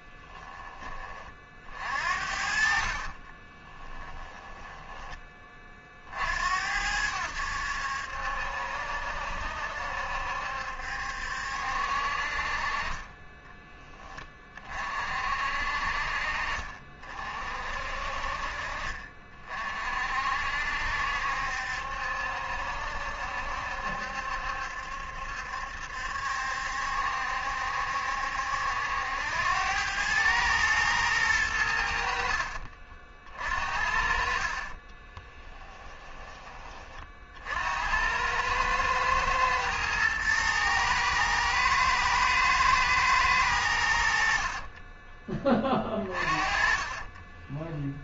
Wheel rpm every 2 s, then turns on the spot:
20, 60, 10, 80, 70, 70, 40, 40, 50, 40, 60, 70, 70, 70, 80, 110, 50, 40, 30, 110, 110, 110, 30, 20.
2-6 34-36 44-48